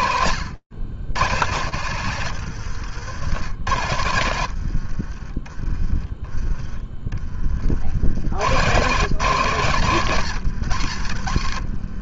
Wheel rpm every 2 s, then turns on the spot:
110, 100, 20, 50, 160, 60.
none